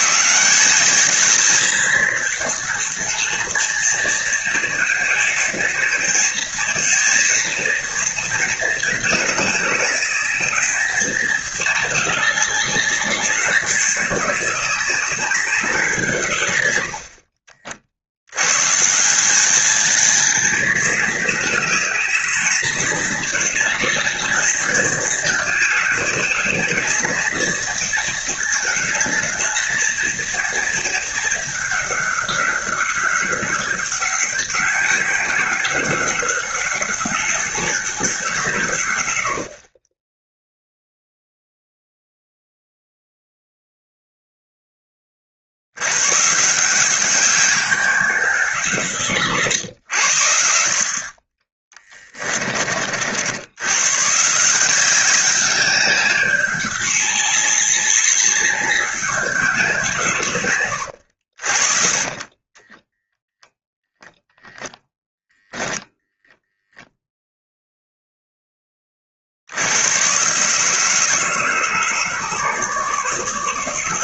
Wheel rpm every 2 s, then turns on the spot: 190, 220, 230, 230, 230, 220, 210, 210, 80, 140, 220, 220, 220, 220, 220, 220, 200, 200, 200, 130, 0, 0, 20, 180, 160, 50, 50, 180, 200, 190, 110, 20, 0, 0, 30, 150, 150.
60-64